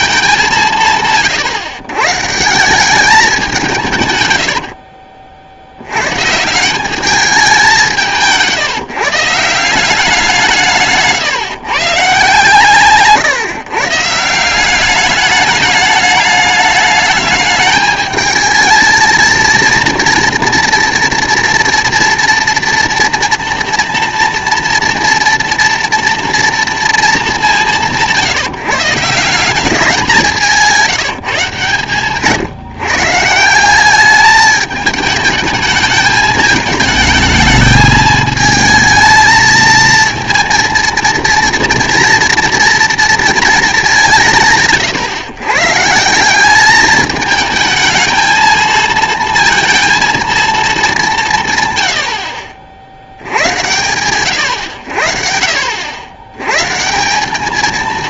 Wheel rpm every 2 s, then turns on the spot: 170, 180, 60, 180, 150, 160, 150, 190, 210, 220, 230, 230, 230, 230, 150, 170, 140, 210, 220, 220, 230, 230, 140, 210, 220, 210, 50, 90, 140.
4-6